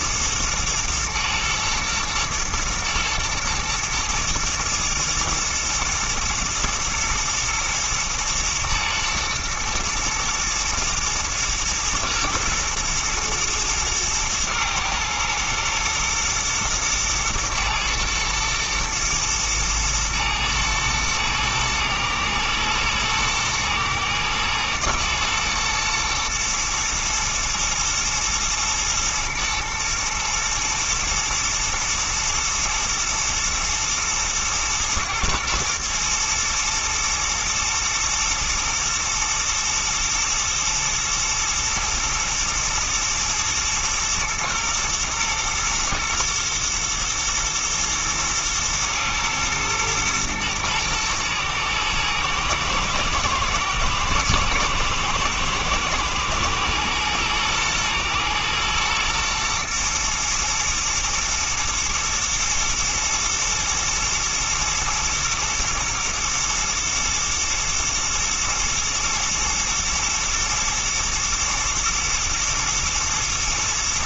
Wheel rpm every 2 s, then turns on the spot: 120, 110, 120, 110, 110, 120, 110, 110, 110, 110, 110, 110, 110, 110, 120, 110, 110, 110, 120, 110, 110, 110, 110, 110, 110, 120, 110, 110, 110, 110, 120, 110, 110, 110, 110, 120, 120.
none